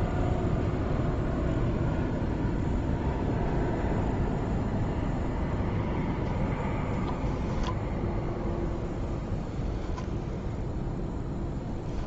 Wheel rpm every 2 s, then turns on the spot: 0, 0, 0, 0, 0, 0.
none